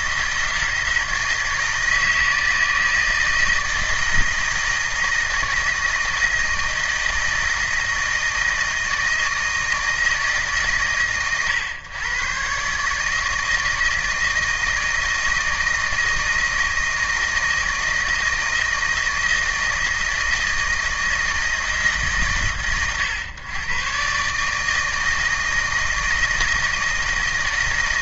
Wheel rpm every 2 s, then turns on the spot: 160, 160, 160, 160, 160, 130, 140, 160, 160, 160, 160, 110, 150, 160.
none